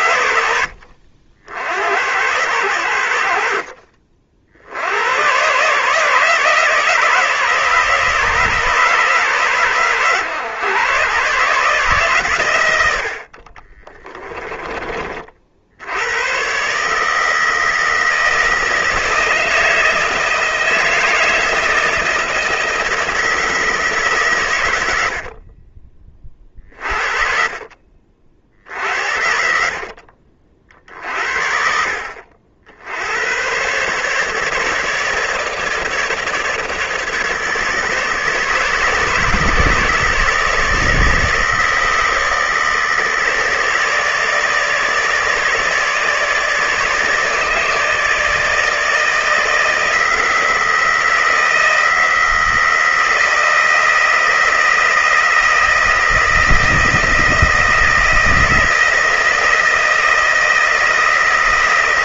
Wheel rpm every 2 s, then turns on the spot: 60, 90, 70, 150, 150, 130, 80, 30, 140, 160, 160, 160, 70, 50, 70, 50, 80, 150, 150, 150, 150, 150, 150, 150, 160, 160, 160, 160, 160, 160, 160.
26-28